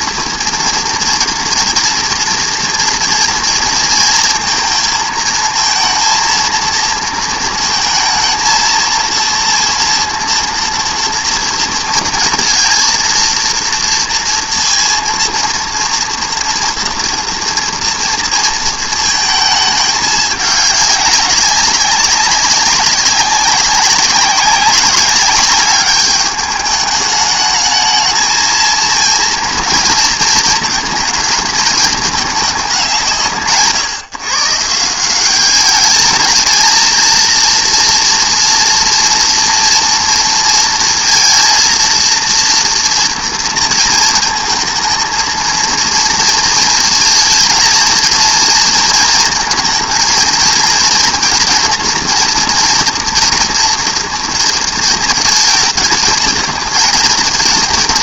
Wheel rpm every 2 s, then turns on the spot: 230, 230, 230, 230, 230, 230, 230, 230, 230, 220, 200, 190, 210, 210, 230, 220, 180, 180, 230, 240, 230, 230, 220, 230, 230, 230, 230, 230, 230.
none